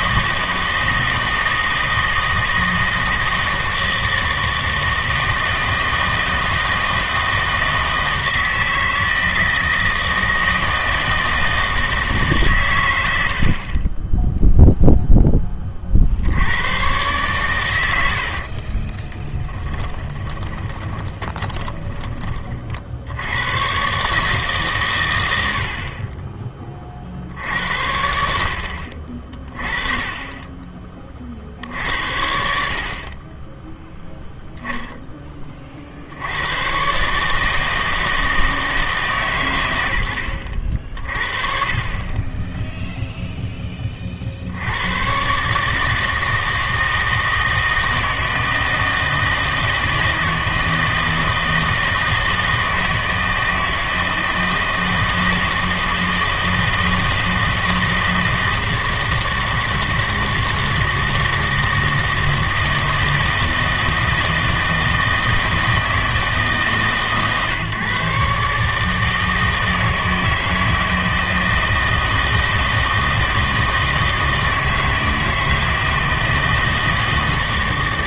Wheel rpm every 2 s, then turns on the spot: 160, 160, 160, 160, 160, 160, 120, 0, 100, 40, 20, 50, 140, 20, 70, 20, 70, 0, 110, 160, 70, 10, 80, 160, 160, 160, 160, 160, 160, 160, 160, 160, 160, 150, 150, 160, 160, 160, 160.
18-22